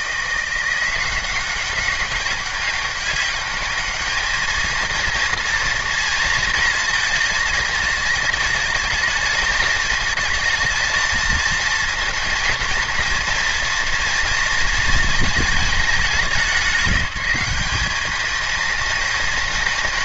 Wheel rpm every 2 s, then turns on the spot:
180, 200, 230, 230, 220, 220, 230, 220, 190, 220.
none